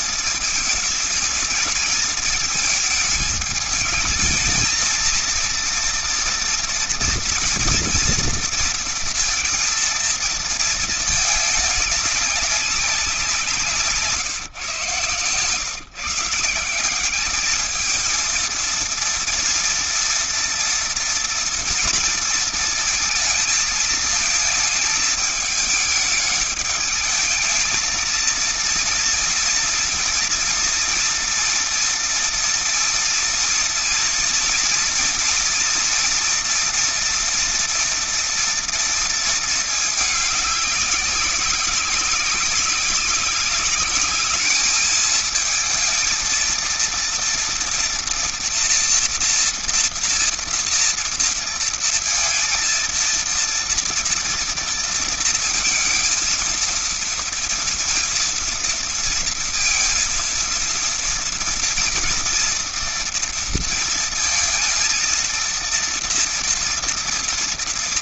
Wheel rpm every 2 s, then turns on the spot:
220, 220, 220, 230, 230, 230, 200, 150, 170, 230, 230, 230, 220, 210, 230, 230, 230, 230, 230, 230, 210, 200, 220, 230, 240, 230, 230, 230, 230, 230, 230, 230, 230, 230.
none